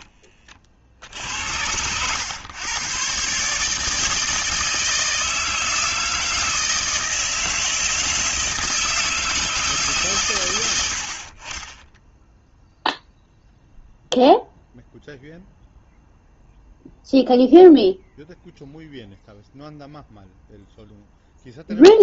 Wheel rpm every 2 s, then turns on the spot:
50, 110, 160, 160, 160, 110, 0, 0, 0, 0, 0.
none